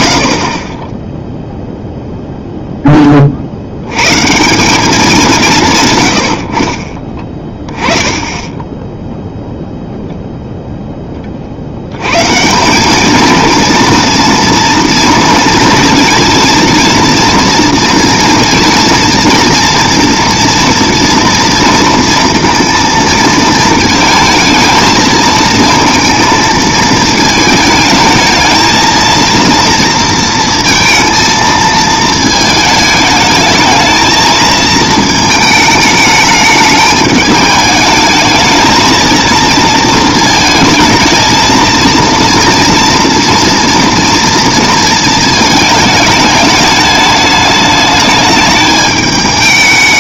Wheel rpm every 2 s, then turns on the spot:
30, 10, 190, 50, 10, 10, 190, 230, 230, 230, 230, 230, 220, 230, 220, 230, 220, 220, 210, 220, 220, 230, 230, 210, 210.
none